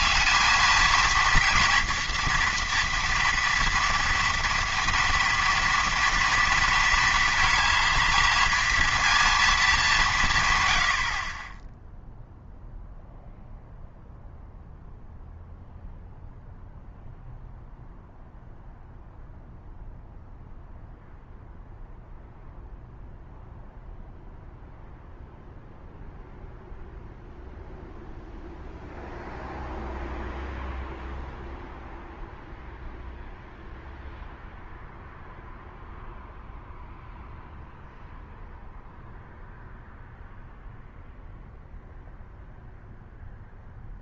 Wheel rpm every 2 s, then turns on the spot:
220, 230, 230, 230, 230, 110, 0, 0, 0, 0, 0, 0, 0, 0, 0, 0, 0, 0, 0, 0, 0, 0.
none